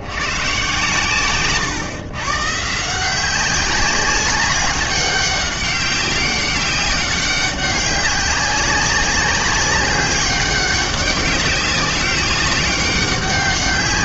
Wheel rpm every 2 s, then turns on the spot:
130, 150, 200, 200, 200, 200, 200.
none